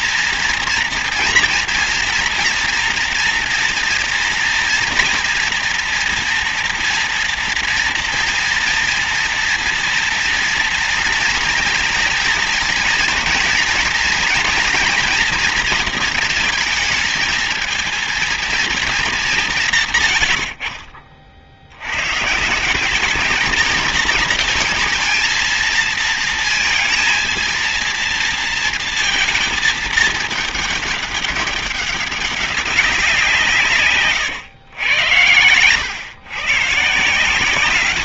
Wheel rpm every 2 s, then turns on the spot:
240, 230, 230, 230, 230, 240, 230, 230, 220, 230, 80, 140, 220, 230, 230, 220, 200, 120, 140.
none